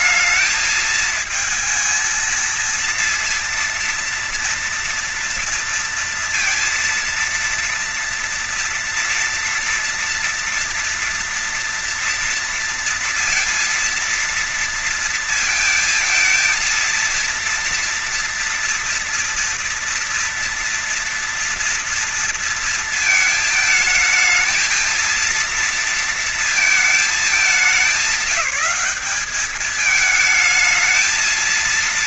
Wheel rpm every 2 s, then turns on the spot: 220, 230, 230, 230, 230, 240, 230, 230, 230, 230, 230, 230, 220, 230, 190, 220.
none